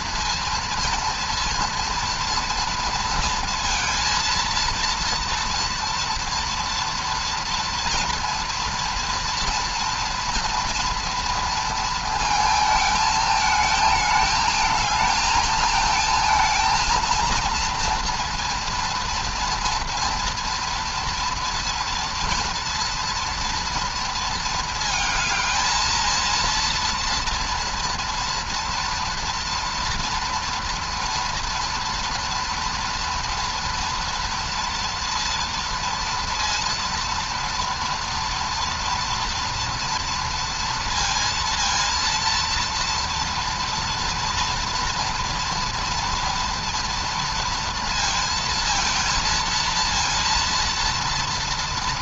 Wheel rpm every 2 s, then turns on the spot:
230, 230, 230, 230, 230, 230, 220, 220, 230, 240, 240, 230, 220, 230, 230, 230, 230, 230, 230, 230, 230, 230, 230, 230, 230, 230.
none